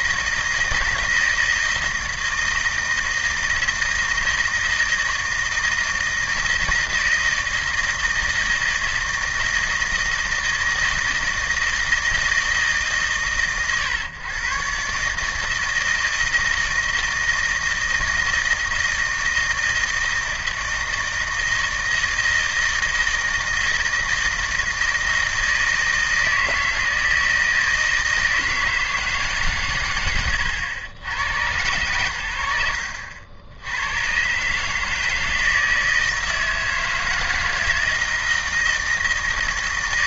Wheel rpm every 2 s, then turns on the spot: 160, 160, 160, 160, 160, 160, 140, 140, 160, 160, 160, 160, 160, 160, 160, 100, 80, 160, 160, 160.
none